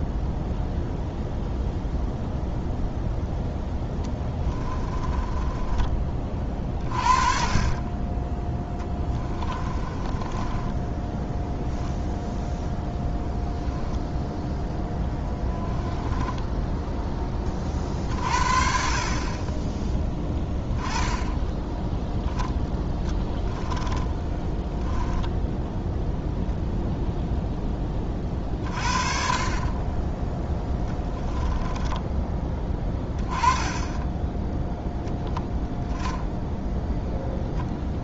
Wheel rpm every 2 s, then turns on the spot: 0, 0, 20, 40, 10, 10, 0, 0, 20, 50, 10, 10, 10, 0, 40, 10, 20, 0, 0.
4-6 8-12 24-26 30-32